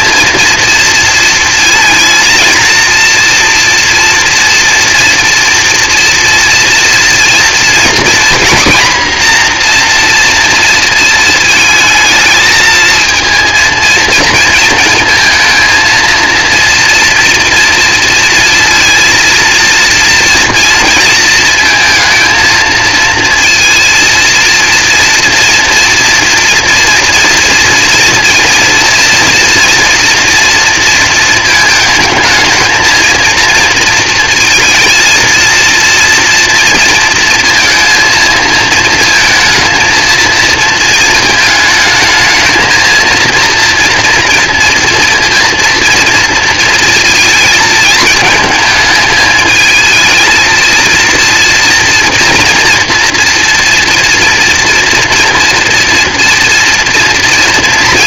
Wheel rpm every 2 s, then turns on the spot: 230, 230, 230, 230, 250, 230, 220, 230, 230, 230, 230, 230, 230, 230, 230, 230, 220, 230, 230, 230, 230, 220, 230, 230, 220, 220, 230, 230, 230.
none